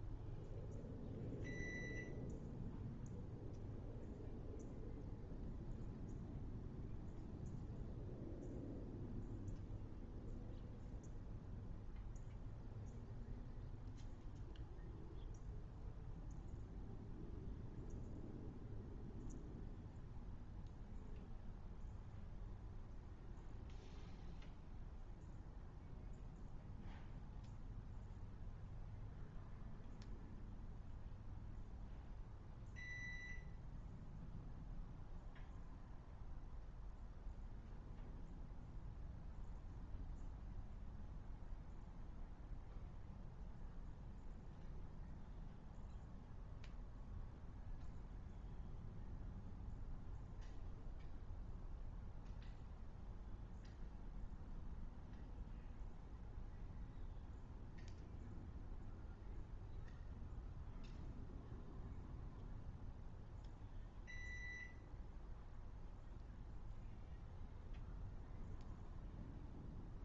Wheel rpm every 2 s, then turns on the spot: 0, 0, 0, 0, 0, 0, 0, 0, 0, 0, 0, 0, 0, 0, 0, 0, 0, 0, 0, 0, 0, 0, 0, 0, 0, 0, 0, 0, 0, 0, 0, 0, 0, 0, 0.
none